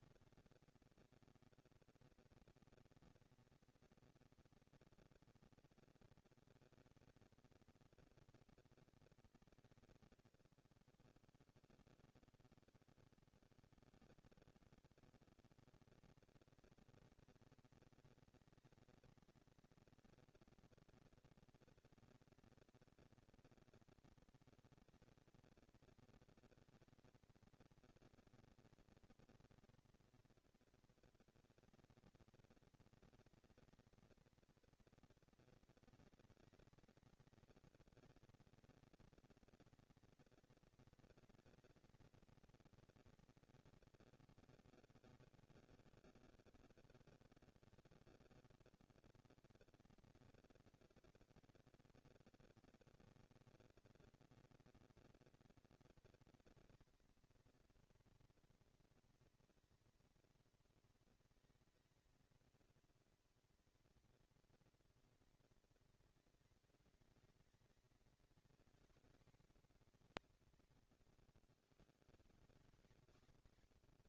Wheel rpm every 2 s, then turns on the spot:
230, 230, 230, 230, 230, 190, 160, 160, 210, 230, 240, 230, 230, 230, 230, 240, 230, 230, 230, 230, 230, 230, 190, 160, 180, 230, 240, 230, 230, 230, 230, 220, 230, 210, 230, 200, 160.
none